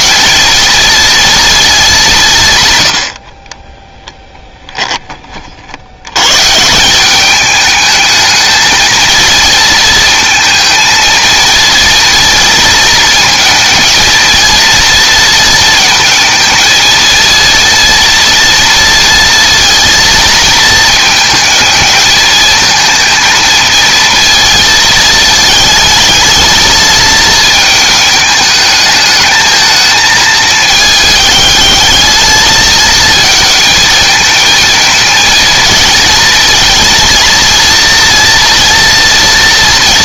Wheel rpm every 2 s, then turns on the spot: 230, 70, 10, 180, 220, 220, 220, 230, 230, 230, 220, 230, 220, 220, 220, 210, 220, 230, 230, 230.
none